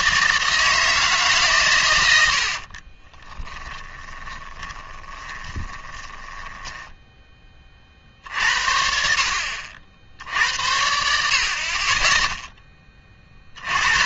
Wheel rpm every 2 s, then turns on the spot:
160, 50, 20, 10, 60, 70, 10.
2-8